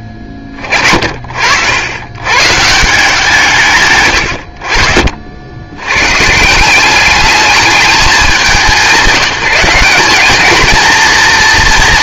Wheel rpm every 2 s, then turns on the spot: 50, 130, 60, 180, 180, 220.
none